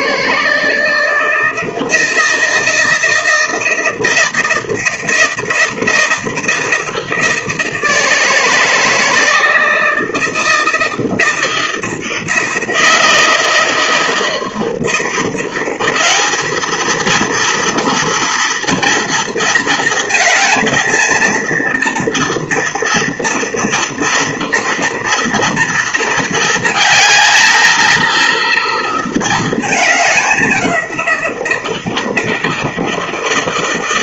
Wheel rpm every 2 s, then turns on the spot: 160, 160, 160, 160, 160, 160, 160, 160, 220, 230, 230, 240, 230, 220, 230, 180, 160.
none